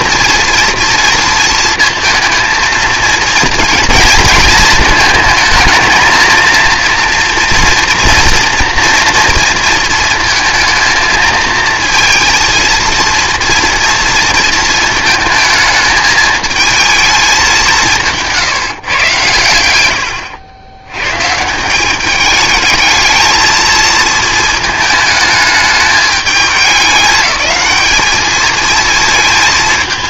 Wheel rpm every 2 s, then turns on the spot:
230, 230, 230, 230, 230, 220, 230, 220, 220, 150, 90, 210, 220, 200, 220.
none